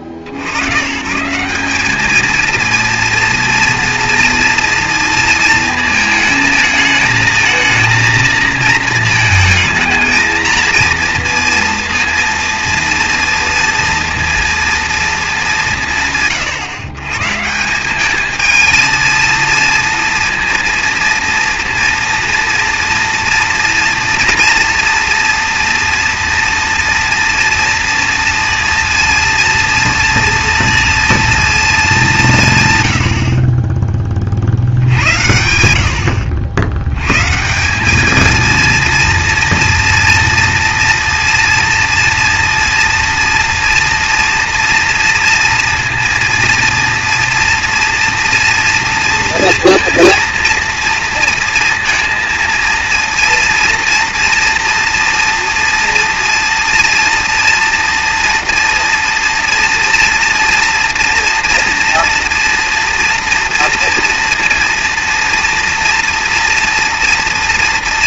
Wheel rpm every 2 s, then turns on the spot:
80, 220, 230, 220, 230, 230, 230, 230, 140, 220, 230, 230, 240, 230, 230, 230, 150, 50, 90, 230, 230, 230, 230, 230, 230, 230, 230, 230, 230, 230, 230, 230, 230, 230.
none